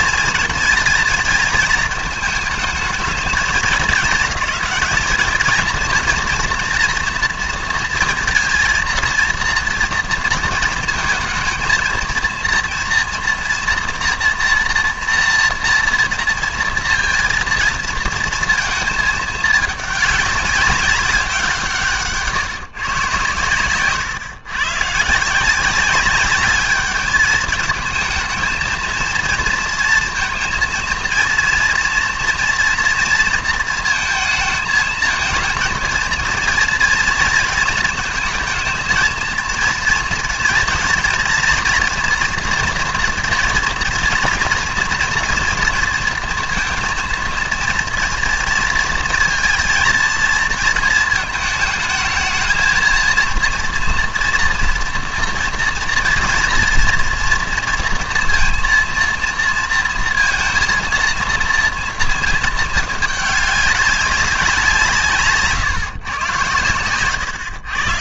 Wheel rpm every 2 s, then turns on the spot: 230, 220, 210, 230, 230, 230, 230, 240, 230, 230, 200, 140, 120, 200, 220, 230, 240, 220, 230, 220, 230, 230, 230, 230, 230, 230, 230, 230, 230, 230, 230, 220, 170, 110.
none